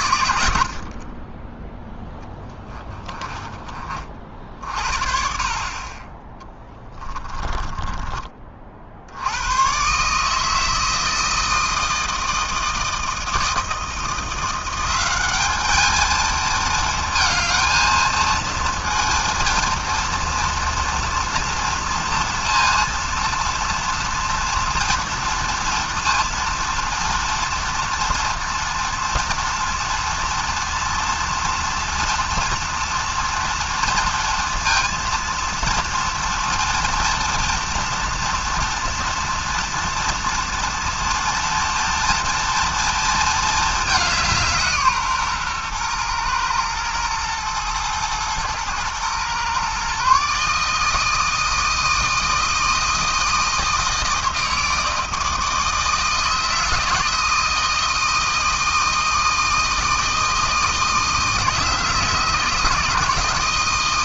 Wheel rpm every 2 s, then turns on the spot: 60, 20, 50, 10, 50, 160, 160, 180, 220, 230, 230, 230, 230, 230, 240, 230, 230, 230, 230, 230, 230, 230, 170, 110, 120, 150, 160, 160, 160, 160, 160, 160.
2-4 6-8